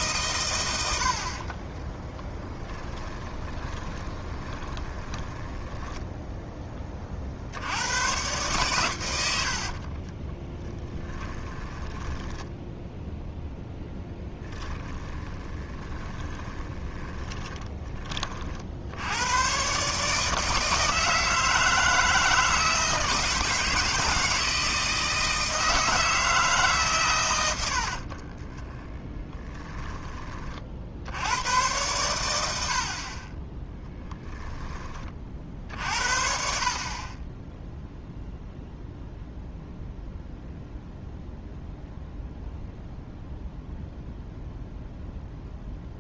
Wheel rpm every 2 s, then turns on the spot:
100, 10, 30, 20, 110, 10, 10, 10, 20, 70, 160, 160, 160, 150, 30, 60, 50, 20, 60, 0, 0, 0, 0.
2-6 10-18 28-30